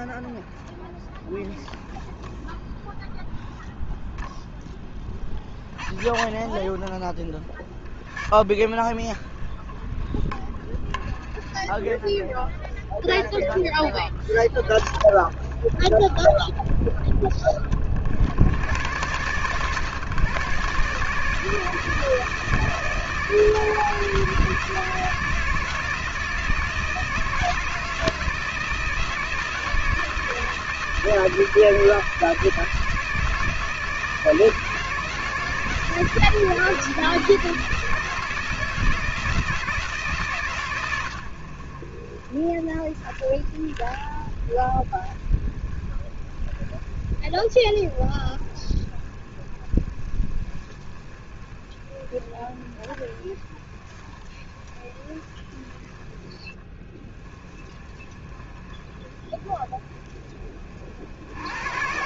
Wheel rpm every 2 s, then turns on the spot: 10, 0, 0, 20, 20, 20, 10, 20, 60, 140, 160, 160, 160, 160, 160, 160, 160, 160, 160, 160, 70, 20, 20, 20, 20, 20, 20, 20, 10, 20, 80.
none